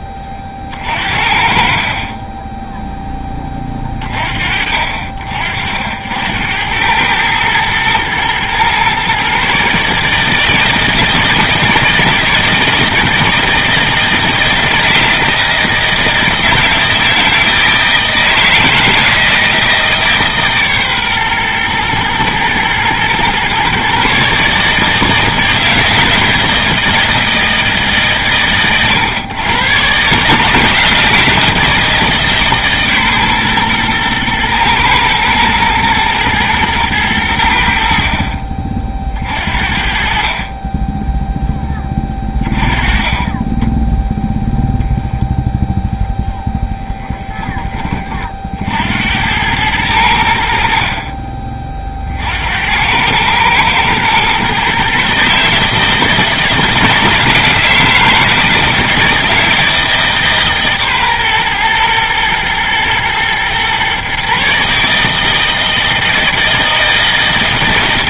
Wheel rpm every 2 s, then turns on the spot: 50, 10, 50, 100, 130, 160, 160, 170, 160, 160, 140, 120, 150, 160, 120, 160, 140, 120, 110, 50, 20, 20, 0, 10, 70, 50, 90, 140, 160, 160, 140, 120, 150, 160.
0-2 46-48